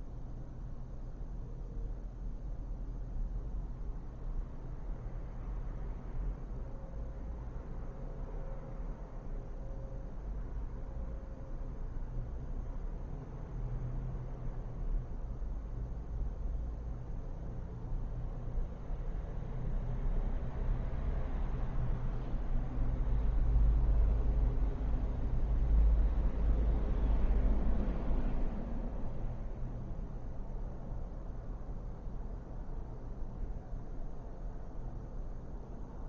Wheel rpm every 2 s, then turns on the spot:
0, 0, 0, 0, 0, 0, 0, 0, 0, 0, 0, 0, 0, 0, 0, 0, 0, 0.
none